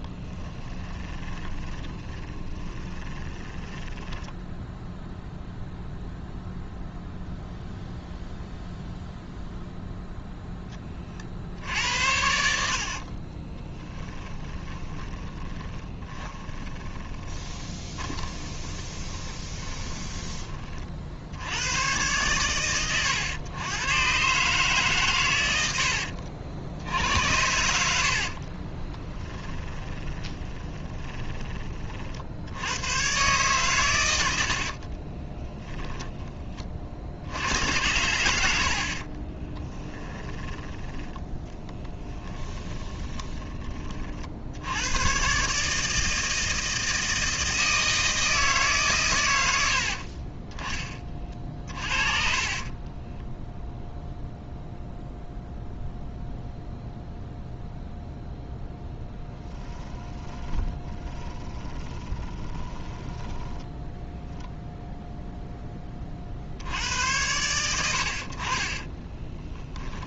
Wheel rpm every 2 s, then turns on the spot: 20, 20, 0, 0, 0, 20, 60, 20, 20, 20, 40, 110, 140, 80, 20, 20, 110, 50, 50, 50, 10, 20, 100, 160, 140, 20, 30, 0, 0, 0, 10, 20, 0, 80, 30.
0-4 12-20 28-32 34-36 38-40 42-44 52-54 60-64 68-70